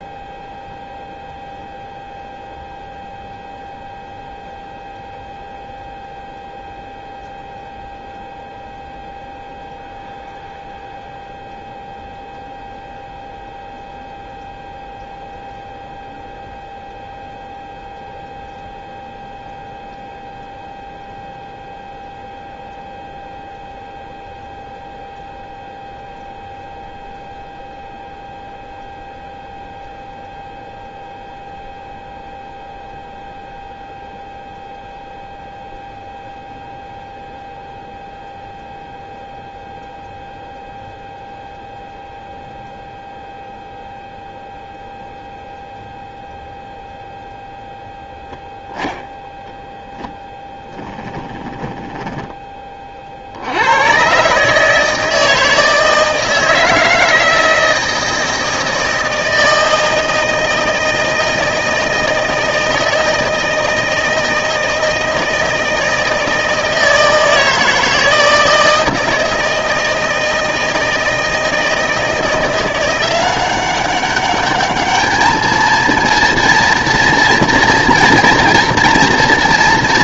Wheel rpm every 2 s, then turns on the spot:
0, 0, 0, 0, 0, 0, 0, 0, 0, 0, 0, 0, 0, 0, 0, 0, 0, 0, 0, 0, 0, 0, 0, 0, 0, 10, 20, 150, 160, 160, 160, 160, 160, 160, 160, 160, 170, 210, 230, 230.
50-52